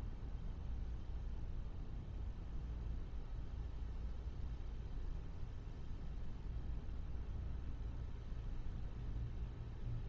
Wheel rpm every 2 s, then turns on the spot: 0, 0, 0, 0, 0.
none